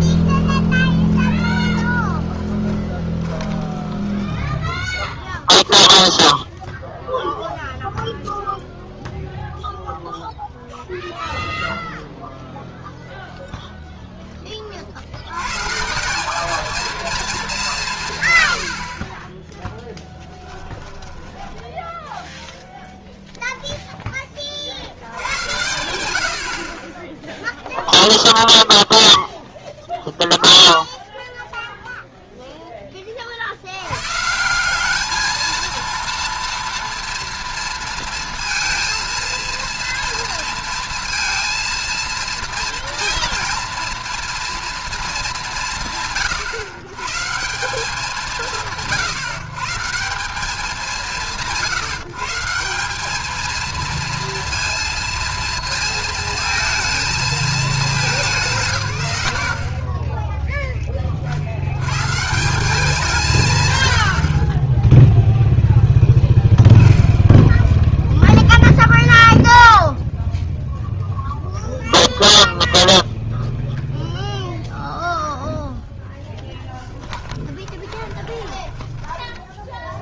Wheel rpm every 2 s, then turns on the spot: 20, 10, 0, 0, 0, 0, 0, 140, 180, 0, 10, 0, 100, 0, 0, 0, 40, 220, 230, 230, 230, 240, 200, 160, 140, 170, 220, 230, 220, 110, 40, 170, 0, 10, 0, 0, 0, 10, 20, 0.
0-4 76-78